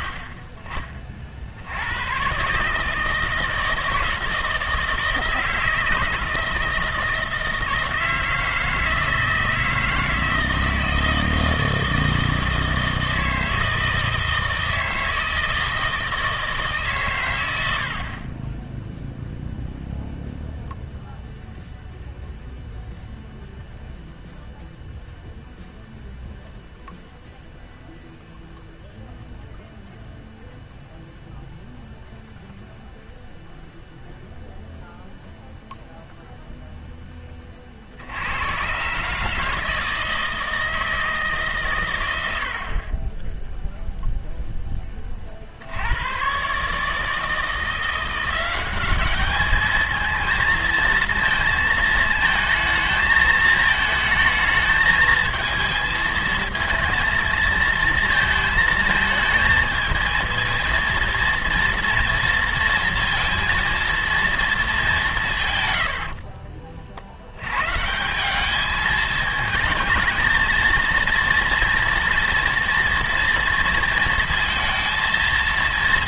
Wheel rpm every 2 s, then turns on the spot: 50, 150, 160, 160, 160, 160, 160, 160, 140, 10, 0, 0, 0, 0, 0, 0, 0, 0, 0, 120, 160, 60, 10, 140, 190, 230, 220, 220, 230, 220, 230, 230, 200, 50, 220, 230, 230, 230.
none